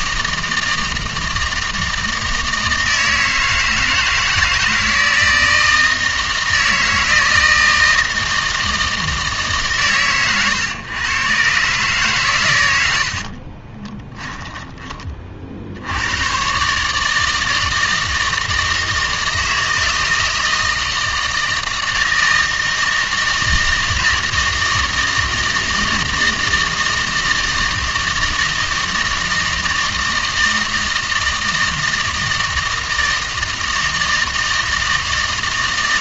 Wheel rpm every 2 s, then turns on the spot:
160, 160, 160, 160, 160, 120, 100, 20, 140, 160, 160, 160, 160, 160, 160, 160, 160, 160.
14-16